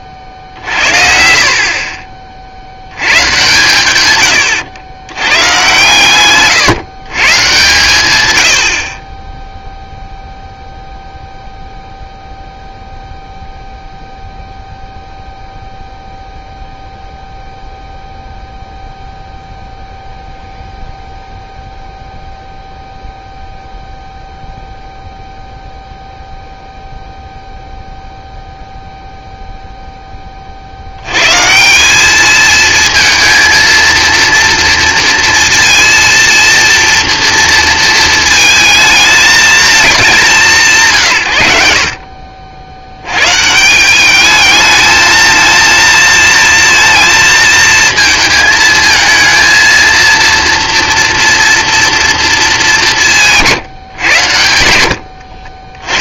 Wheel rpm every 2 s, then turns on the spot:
50, 90, 90, 140, 80, 0, 0, 0, 0, 0, 0, 0, 0, 0, 0, 60, 220, 230, 230, 220, 170, 80, 220, 230, 220, 230, 180, 80.
0-2